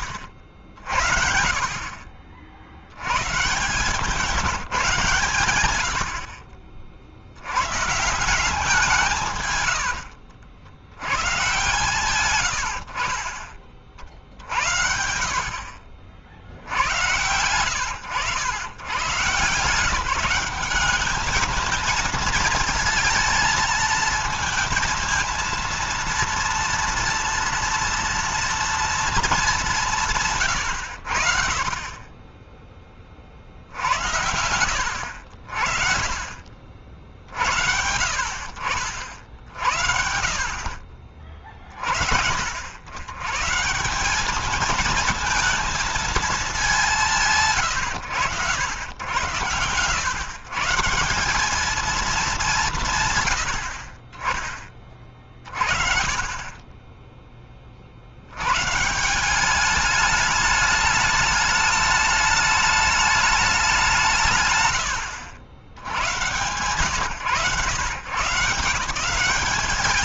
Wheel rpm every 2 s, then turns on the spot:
60, 70, 160, 50, 180, 90, 110, 70, 70, 110, 190, 220, 230, 230, 230, 110, 20, 70, 50, 60, 50, 70, 210, 210, 110, 150, 180, 20, 20, 110, 210, 210, 130, 110, 150.
none